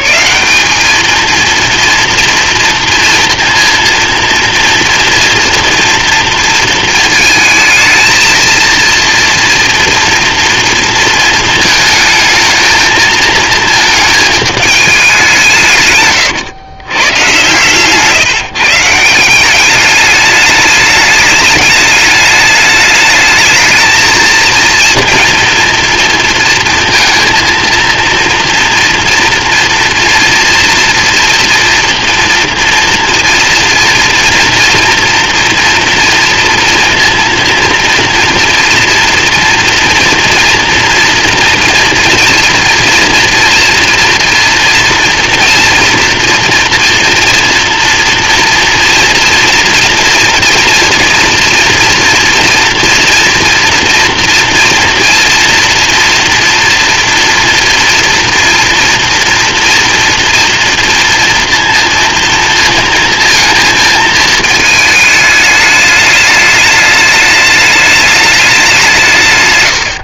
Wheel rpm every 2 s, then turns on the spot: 210, 230, 230, 230, 230, 230, 220, 210, 120, 150, 210, 210, 230, 230, 230, 230, 230, 230, 230, 230, 230, 230, 230, 230, 230, 230, 230, 230, 240, 240, 230, 230, 220, 210, 190.
none